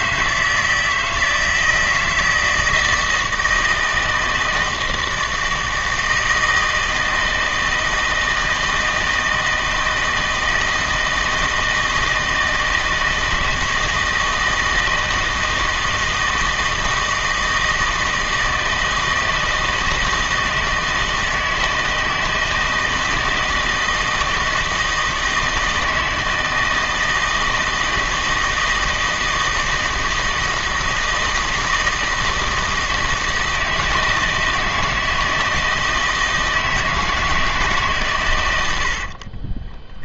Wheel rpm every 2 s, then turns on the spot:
160, 160, 160, 160, 160, 160, 160, 160, 160, 160, 160, 160, 160, 160, 160, 160, 160, 160, 160, 80.
38-40